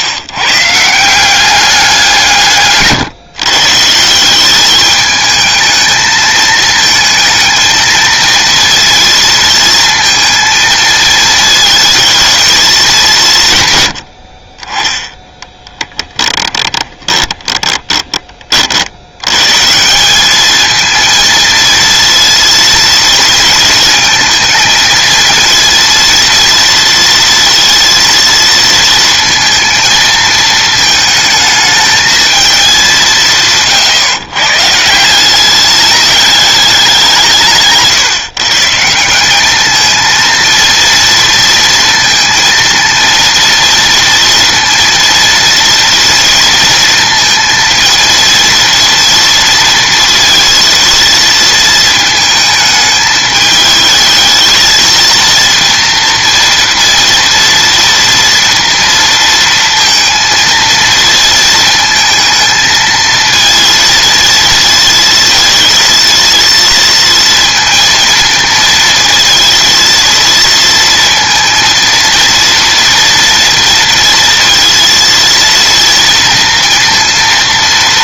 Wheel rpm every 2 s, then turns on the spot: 160, 130, 210, 220, 230, 220, 200, 20, 10, 60, 230, 230, 230, 230, 230, 220, 200, 160, 190, 170, 230, 230, 230, 230, 230, 230, 220, 220, 230, 230, 230, 220, 220, 230, 230, 230, 230, 230, 230.
16-18